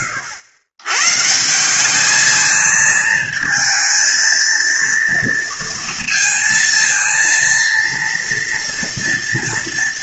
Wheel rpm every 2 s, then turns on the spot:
120, 220, 230, 230, 230.
none